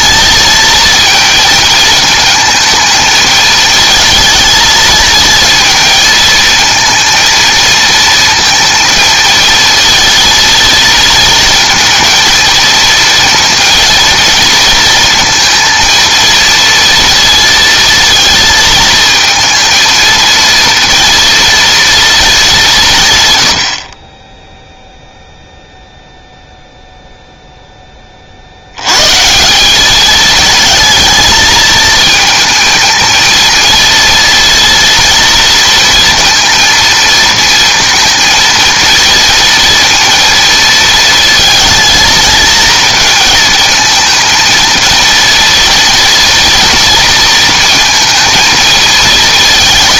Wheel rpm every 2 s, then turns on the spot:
220, 220, 230, 220, 230, 230, 220, 230, 230, 220, 230, 180, 0, 0, 80, 220, 220, 230, 230, 230, 230, 220, 230, 230, 230.
none